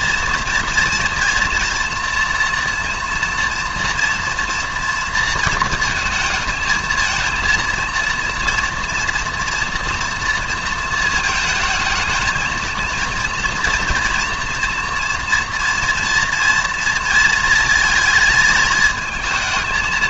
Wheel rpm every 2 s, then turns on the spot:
240, 230, 230, 220, 230, 230, 230, 230, 230, 220.
none